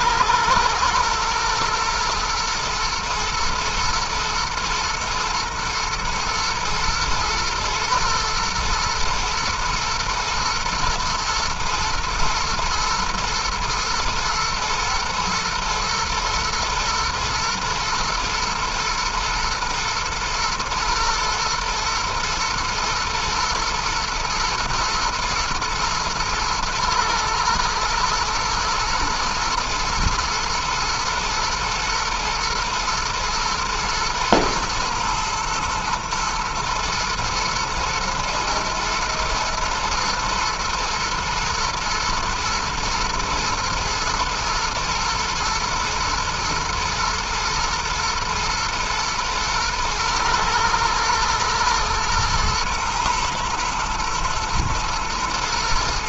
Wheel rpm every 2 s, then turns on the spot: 120, 120, 120, 120, 110, 110, 120, 120, 120, 110, 110, 110, 120, 120, 110, 120, 110, 110, 110, 110, 120, 110, 110, 120, 120, 110, 110, 120.
none